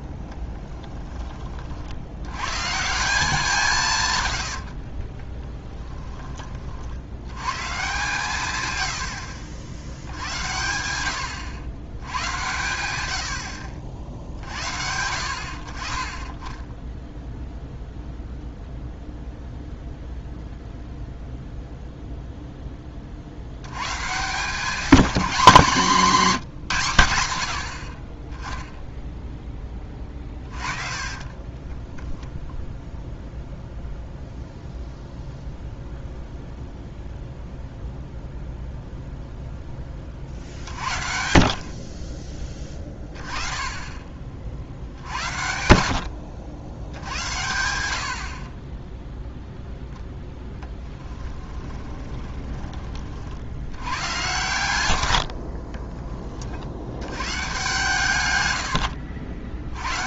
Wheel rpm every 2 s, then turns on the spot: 10, 140, 70, 50, 120, 80, 70, 60, 10, 0, 0, 20, 200, 170, 10, 40, 10, 0, 0, 0, 50, 20, 60, 90, 20, 10, 30, 70, 80, 70.
4-6 30-32 58-60